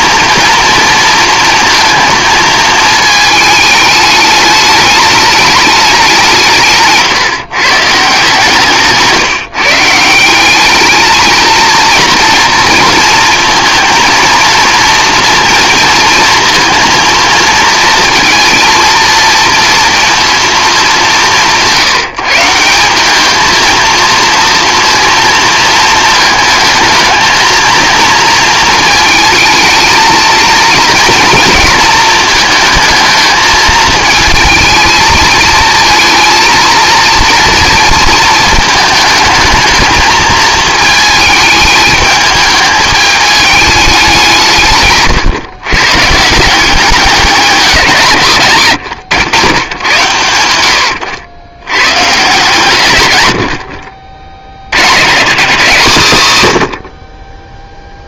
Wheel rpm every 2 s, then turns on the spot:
230, 220, 210, 160, 160, 200, 230, 230, 230, 230, 210, 180, 230, 220, 230, 230, 220, 220, 220, 220, 220, 210, 160, 190, 120, 90, 130, 70, 110.
8-10